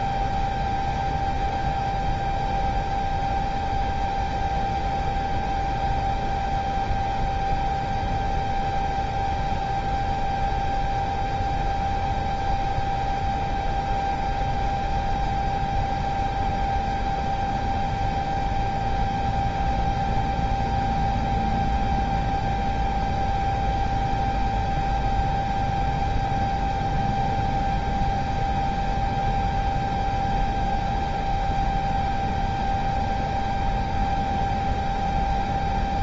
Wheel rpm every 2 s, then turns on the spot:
0, 0, 0, 0, 0, 0, 0, 0, 0, 0, 0, 0, 0, 0, 0, 0, 0, 0.
none